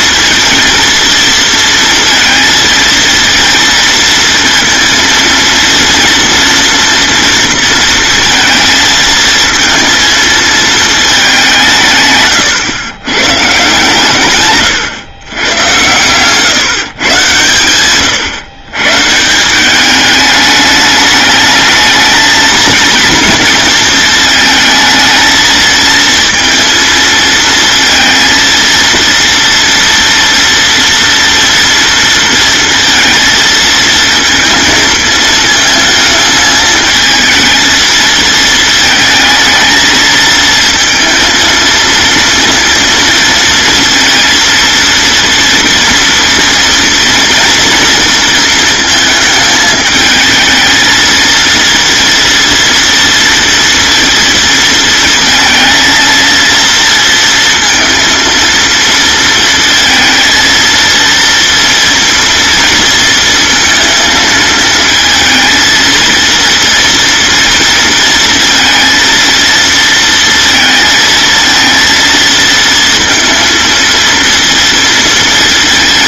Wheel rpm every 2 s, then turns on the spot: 230, 230, 230, 230, 220, 220, 130, 120, 140, 140, 210, 230, 220, 230, 230, 230, 230, 220, 220, 220, 230, 230, 230, 230, 220, 220, 230, 230, 230, 230, 230, 230, 230, 230, 230, 230, 230, 230.
none